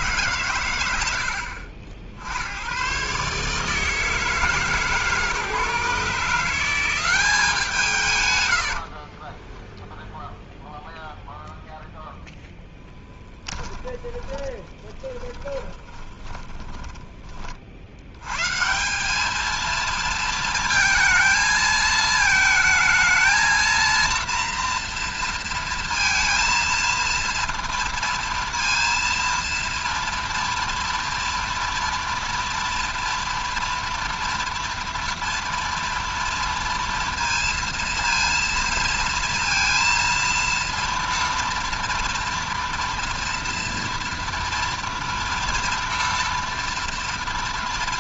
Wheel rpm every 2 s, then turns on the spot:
70, 160, 160, 130, 0, 0, 20, 20, 60, 230, 220, 230, 230, 230, 230, 230, 230, 230, 230, 230, 230, 230, 230, 230.
12-16